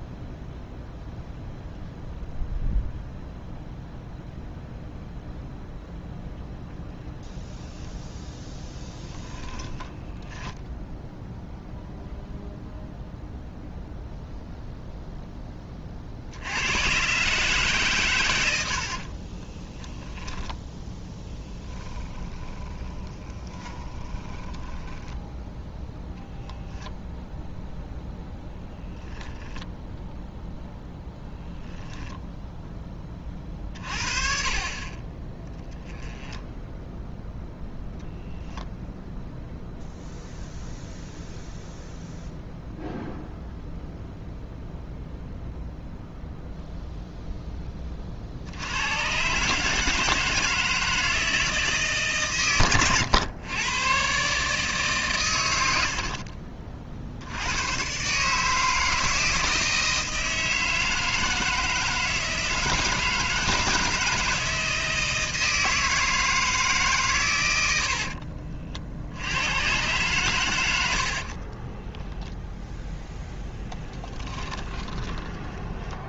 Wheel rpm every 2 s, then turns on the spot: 0, 0, 0, 0, 10, 10, 0, 0, 110, 60, 10, 10, 10, 0, 0, 0, 10, 40, 10, 0, 0, 0, 0, 0, 120, 160, 110, 140, 50, 160, 160, 150, 160, 140, 60, 80, 0, 10.
18-20 22-26 36-38 74-76